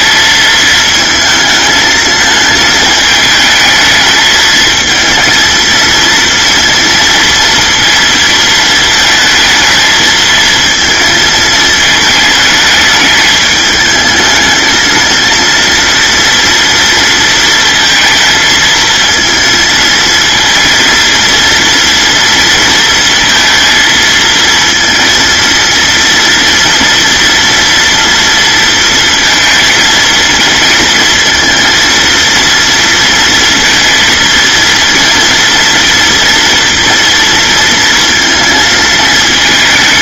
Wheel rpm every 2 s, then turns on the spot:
220, 220, 220, 230, 220, 220, 210, 220, 230, 230, 230, 230, 230, 230, 230, 230, 230, 230, 240, 230.
none